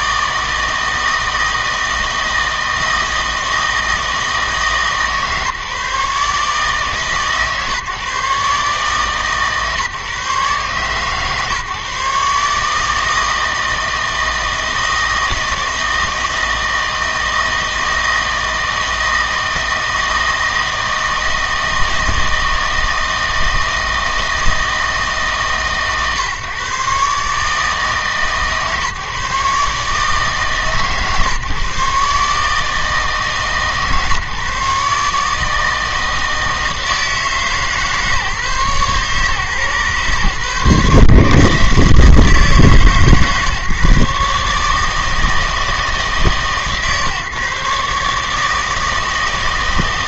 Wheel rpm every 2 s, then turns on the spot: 160, 160, 160, 150, 140, 130, 150, 160, 160, 160, 160, 160, 160, 130, 150, 140, 150, 150, 160, 140, 130, 150, 150, 140, 160.
none